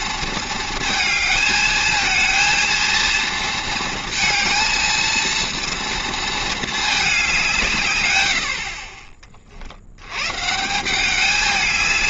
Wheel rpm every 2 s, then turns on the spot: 230, 230, 230, 220, 50, 160.
none